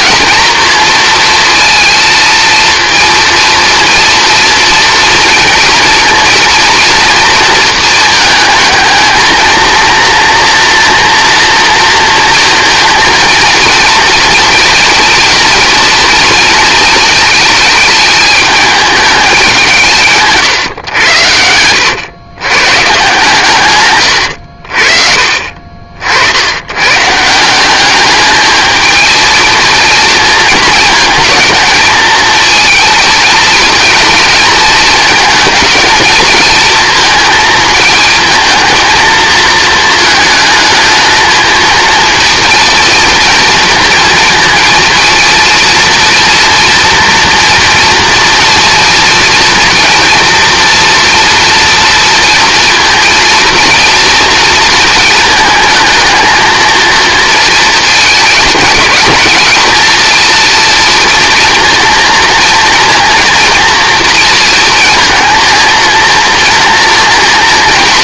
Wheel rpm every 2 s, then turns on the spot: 230, 230, 230, 230, 220, 240, 230, 240, 230, 210, 130, 130, 60, 100, 220, 230, 220, 230, 220, 220, 220, 230, 230, 230, 230, 230, 230, 230, 220, 220, 230, 230, 230, 240.
24-26